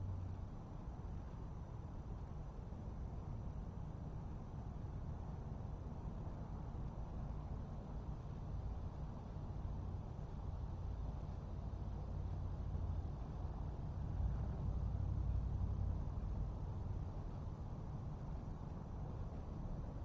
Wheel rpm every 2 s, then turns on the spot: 0, 0, 0, 0, 0, 0, 0, 0, 0, 0.
none